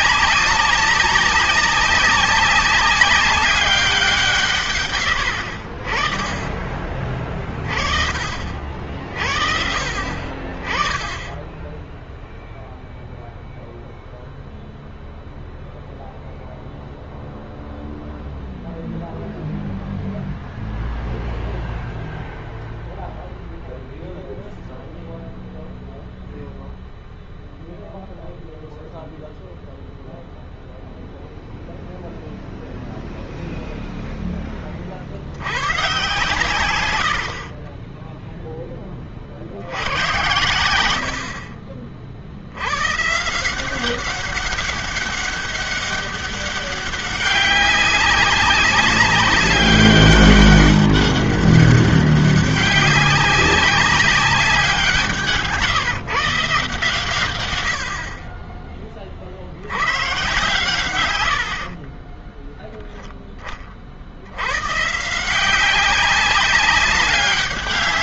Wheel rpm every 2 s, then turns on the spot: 190, 200, 130, 30, 50, 20, 0, 0, 0, 0, 0, 0, 0, 0, 0, 0, 0, 20, 120, 30, 70, 110, 200, 200, 200, 200, 200, 190, 150, 20, 120, 0, 100, 200.
4-6 40-42